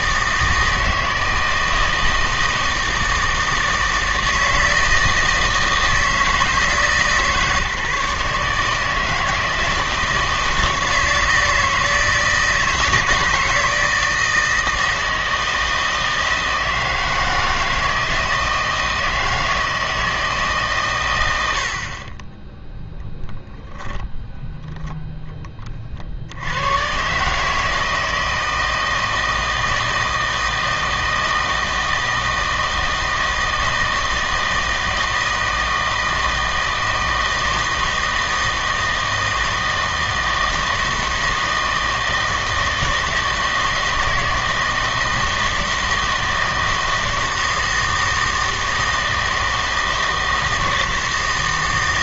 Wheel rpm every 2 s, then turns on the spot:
160, 160, 160, 160, 150, 160, 160, 160, 160, 160, 140, 0, 0, 110, 160, 160, 160, 160, 160, 160, 160, 160, 160, 160, 160, 160.
none